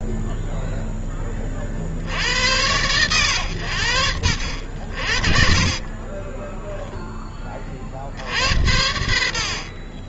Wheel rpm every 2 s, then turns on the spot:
10, 90, 70, 10, 70.
8-10